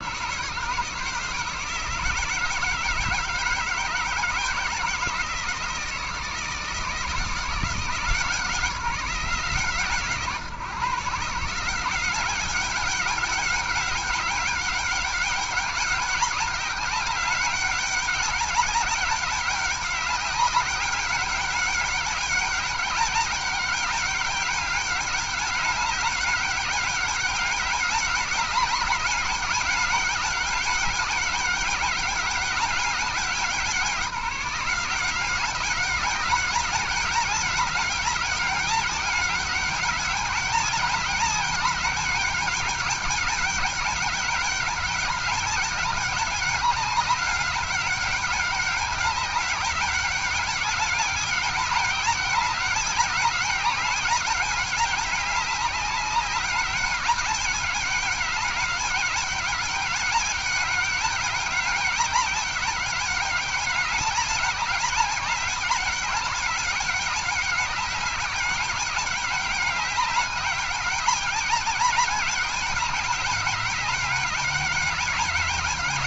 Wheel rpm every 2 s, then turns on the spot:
150, 160, 160, 160, 170, 150, 190, 200, 200, 190, 200, 200, 200, 200, 200, 200, 200, 170, 200, 200, 200, 200, 200, 200, 200, 200, 190, 200, 200, 200, 200, 200, 190, 200, 200, 200, 200, 200.
none